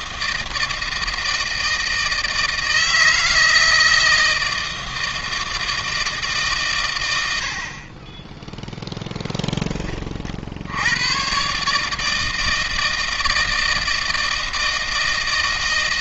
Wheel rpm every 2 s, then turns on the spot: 160, 160, 160, 110, 0, 100, 160, 160.
none